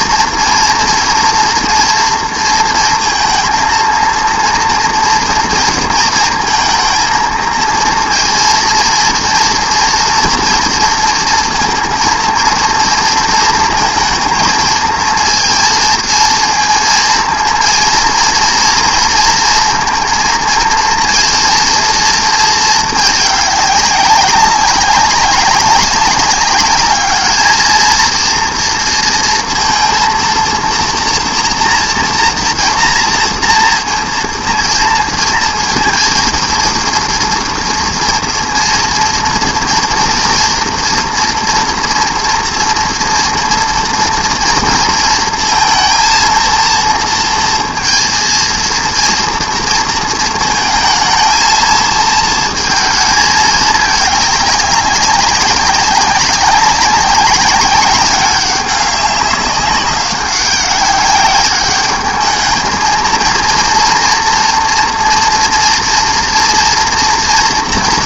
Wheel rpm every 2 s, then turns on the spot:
230, 230, 230, 230, 230, 230, 230, 220, 230, 230, 230, 220, 200, 210, 230, 230, 230, 230, 230, 230, 230, 230, 230, 230, 230, 230, 230, 200, 190, 200, 200, 220, 230, 230.
none